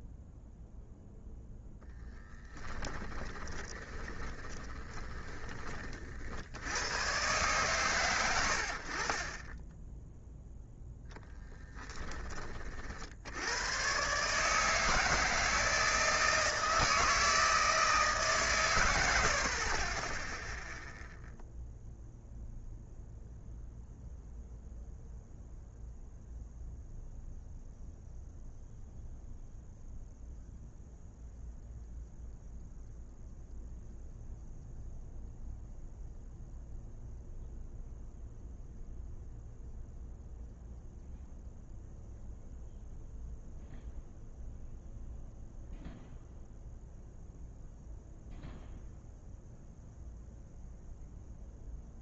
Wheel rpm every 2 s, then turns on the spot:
0, 20, 20, 90, 70, 0, 40, 150, 160, 110, 0, 0, 0, 0, 0, 0, 0, 0, 0, 0, 0, 0, 0, 0, 0, 0.
2-6